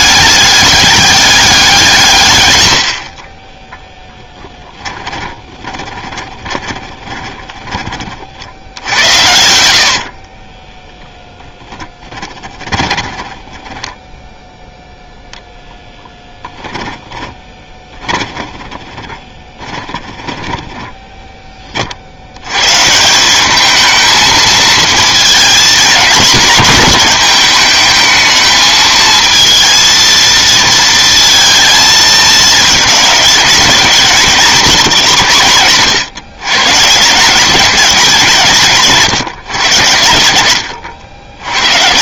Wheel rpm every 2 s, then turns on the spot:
210, 160, 10, 20, 70, 30, 20, 0, 10, 20, 20, 110, 230, 210, 220, 230, 220, 200, 140, 140, 50.
4-14 16-22